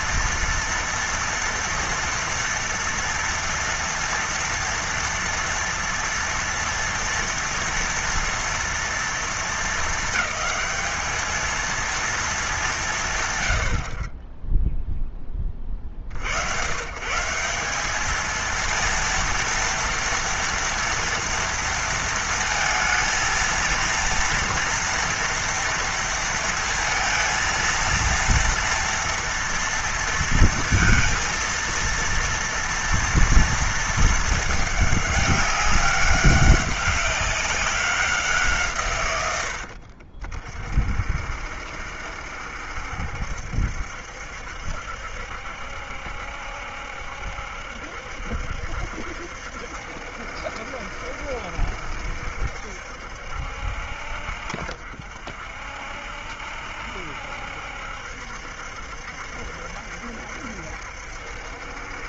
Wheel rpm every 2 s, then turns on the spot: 230, 230, 230, 230, 230, 220, 130, 20, 160, 230, 230, 230, 230, 230, 230, 230, 230, 210, 200, 120, 50, 70, 70, 70, 70, 70, 70, 60, 60, 70, 70.
none